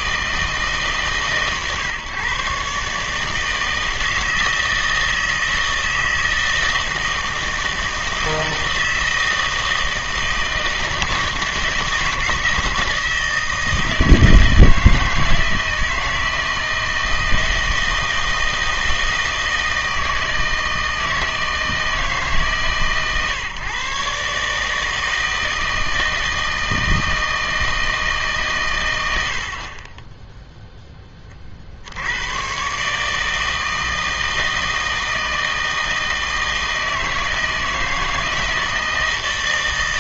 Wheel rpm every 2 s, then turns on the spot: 160, 140, 160, 160, 160, 160, 160, 160, 160, 160, 160, 140, 160, 160, 140, 0, 120, 160, 160, 160.
none